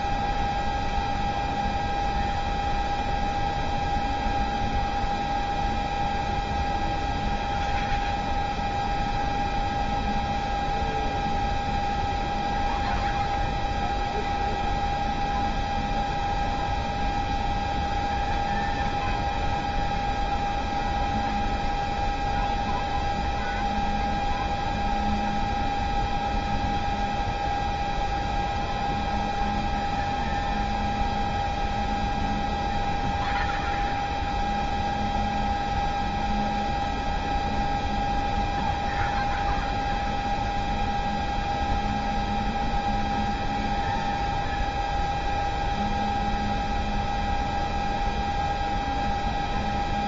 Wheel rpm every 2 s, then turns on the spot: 0, 0, 0, 0, 0, 0, 0, 0, 0, 0, 0, 0, 0, 0, 0, 0, 0, 0, 0, 0, 0, 0, 0, 0, 0.
none